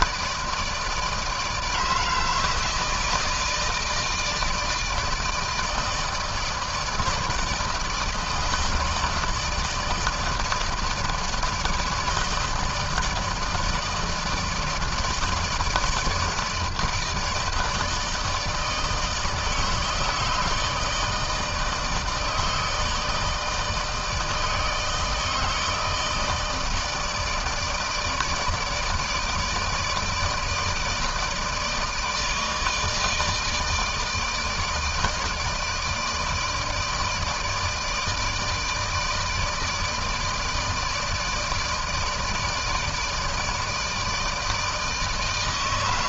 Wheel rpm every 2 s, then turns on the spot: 160, 160, 160, 150, 160, 160, 160, 160, 160, 160, 150, 160, 160, 160, 160, 160, 160, 160, 160, 160, 160, 160, 160.
none